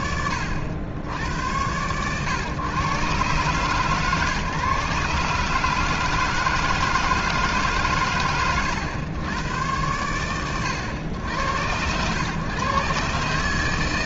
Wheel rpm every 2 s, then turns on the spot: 80, 130, 140, 160, 90, 90, 130.
none